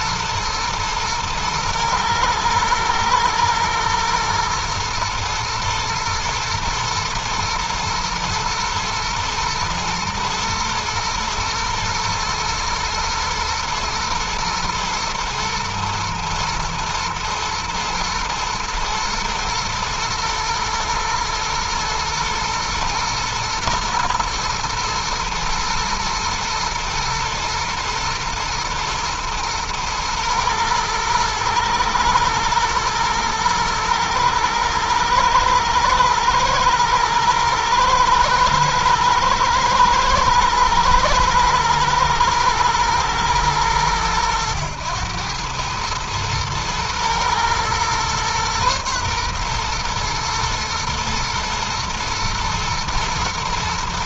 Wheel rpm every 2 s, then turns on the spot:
110, 110, 110, 120, 110, 110, 110, 110, 120, 110, 110, 110, 120, 110, 110, 110, 120, 110, 120, 110, 110, 120, 110, 110, 120, 110, 110.
none